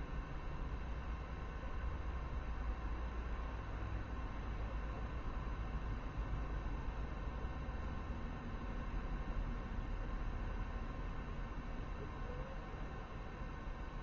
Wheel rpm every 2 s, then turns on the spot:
0, 0, 0, 0, 0, 0, 0.
none